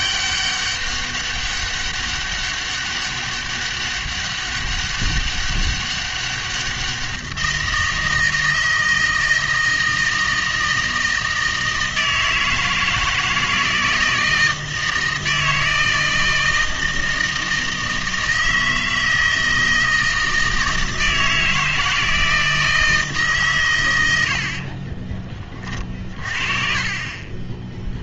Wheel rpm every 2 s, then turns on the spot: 200, 200, 200, 190, 160, 160, 160, 160, 160, 160, 160, 160, 40, 30.
24-26